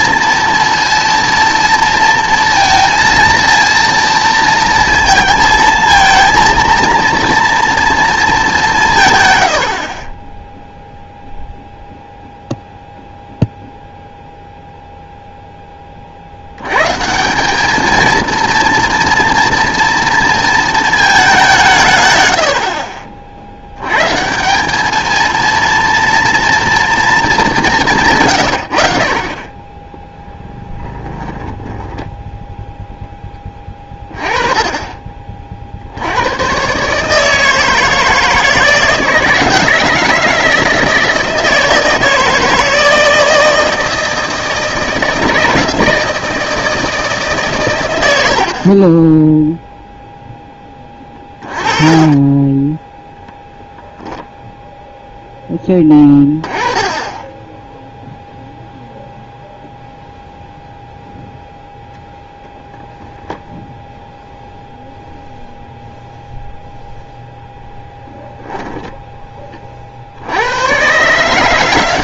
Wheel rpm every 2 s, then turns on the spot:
230, 230, 230, 230, 190, 0, 0, 0, 100, 230, 230, 70, 190, 230, 70, 10, 0, 30, 130, 160, 160, 160, 160, 160, 60, 10, 20, 0, 20, 0, 0, 0, 0, 0, 0, 120.
50-54